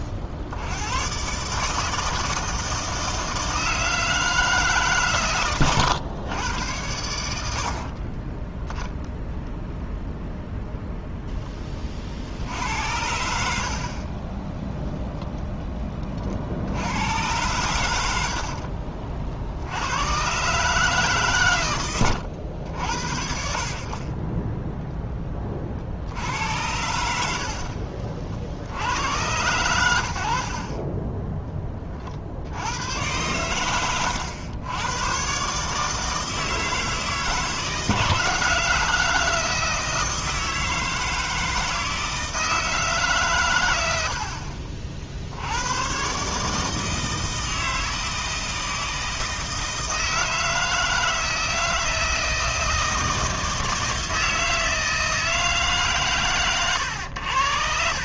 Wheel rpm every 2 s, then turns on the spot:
70, 160, 140, 100, 10, 0, 80, 10, 70, 60, 140, 80, 10, 90, 70, 40, 90, 100, 160, 160, 160, 160, 50, 150, 160, 160, 160, 160, 100.
30-32